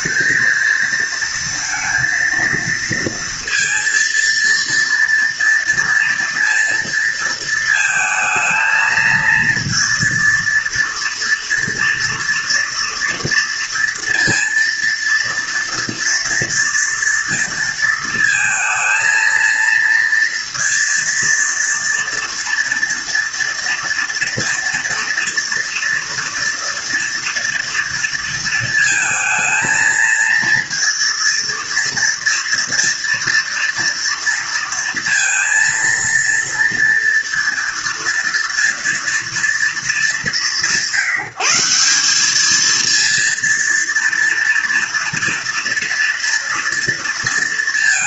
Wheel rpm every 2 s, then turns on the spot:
230, 230, 230, 230, 220, 230, 230, 230, 230, 230, 230, 240, 230, 230, 230, 230, 230, 230, 230, 230, 170, 220, 230, 230.
none